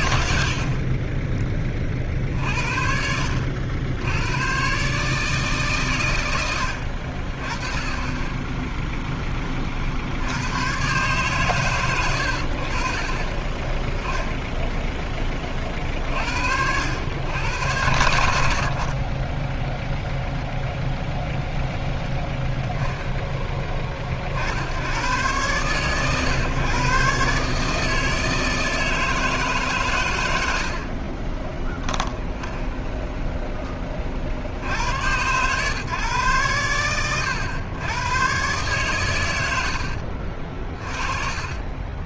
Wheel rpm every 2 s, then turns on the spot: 40, 70, 130, 80, 10, 130, 50, 10, 90, 50, 0, 10, 60, 130, 160, 50, 0, 90, 100, 120, 30.
0-2 30-32 40-42